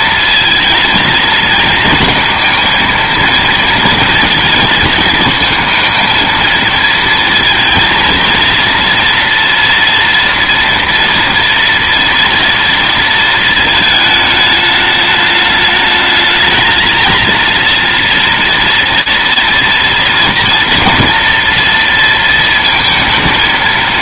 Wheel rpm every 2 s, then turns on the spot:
230, 230, 230, 220, 230, 240, 230, 210, 220, 230, 230, 230.
none